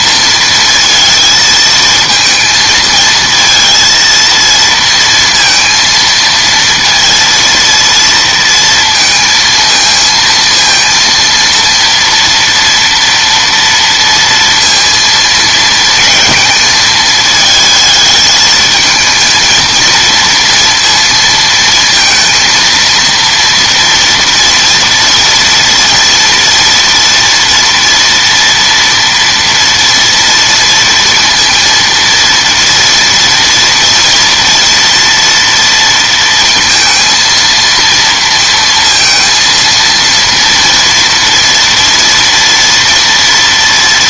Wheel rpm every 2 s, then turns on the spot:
220, 220, 230, 230, 230, 230, 230, 230, 220, 220, 230, 230, 230, 230, 230, 230, 230, 240, 230, 230, 230, 230.
none